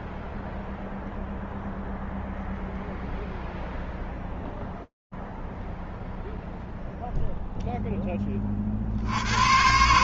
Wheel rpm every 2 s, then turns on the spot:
0, 0, 0, 0, 0.
none